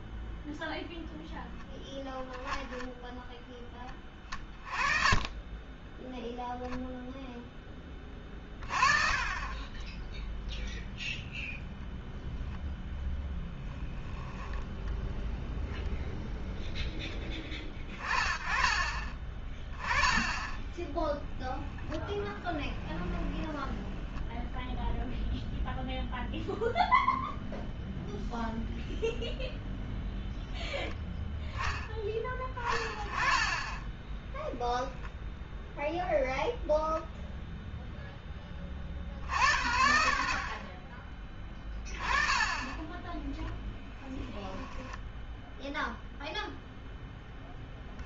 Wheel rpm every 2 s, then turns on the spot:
0, 0, 30, 0, 20, 0, 0, 0, 10, 30, 10, 10, 0, 0, 0, 0, 20, 0, 0, 40, 40, 10, 10, 0.
20-22 44-46